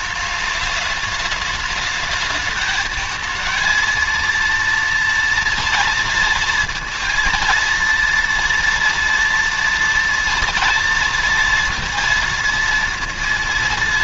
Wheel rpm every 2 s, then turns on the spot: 210, 220, 230, 230, 230, 230, 230.
none